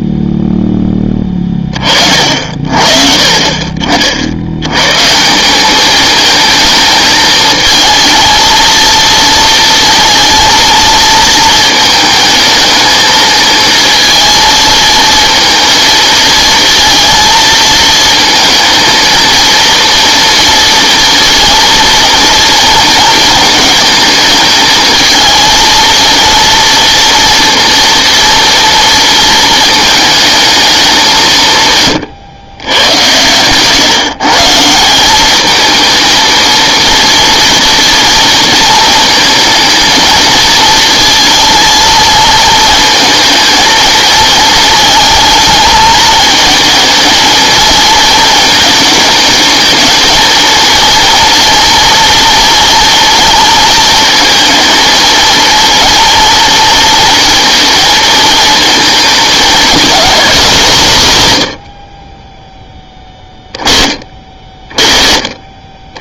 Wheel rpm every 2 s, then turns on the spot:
10, 50, 100, 220, 230, 230, 220, 230, 220, 220, 240, 230, 220, 230, 230, 200, 100, 170, 230, 220, 230, 230, 230, 220, 230, 230, 230, 230, 230, 230, 180, 10, 30.
none